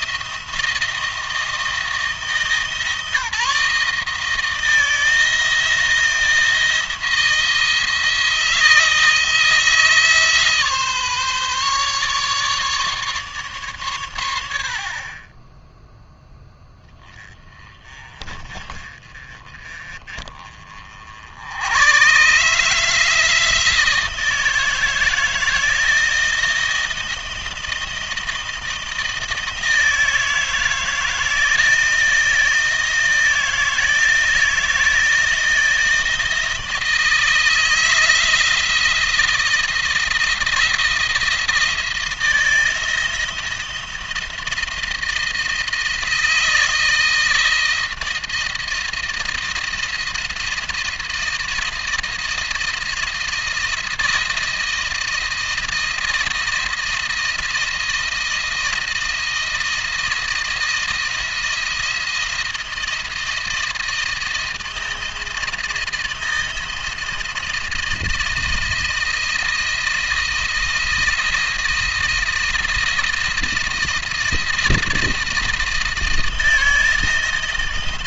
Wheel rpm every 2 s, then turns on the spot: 160, 160, 160, 160, 160, 150, 150, 50, 10, 30, 50, 160, 160, 160, 160, 160, 160, 160, 160, 160, 160, 170, 170, 160, 160, 160, 160, 160, 160, 170, 170, 160, 160, 170, 170, 170, 160, 160, 160.
none